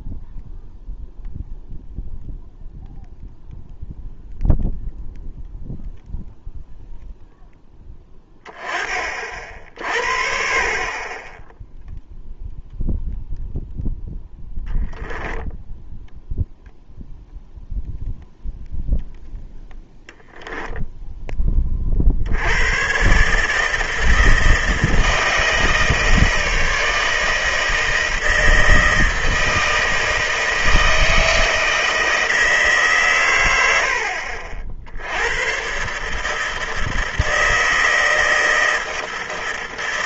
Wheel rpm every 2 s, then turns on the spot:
0, 0, 0, 0, 30, 40, 0, 10, 0, 0, 0, 110, 160, 160, 160, 160, 140, 70, 160, 160.
none